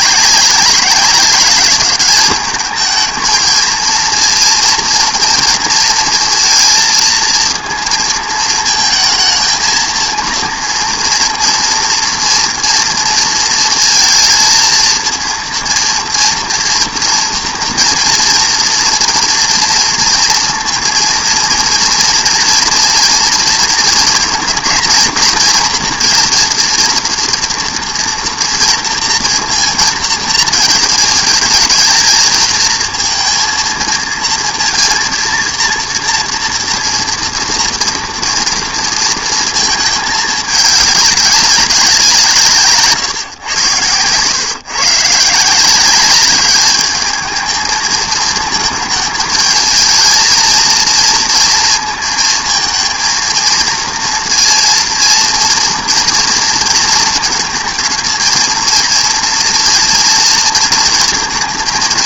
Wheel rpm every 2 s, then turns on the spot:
190, 210, 230, 230, 230, 230, 230, 220, 230, 230, 230, 230, 230, 230, 230, 220, 230, 230, 230, 230, 200, 150, 130, 210, 220, 230, 220, 230, 230, 230, 230.
none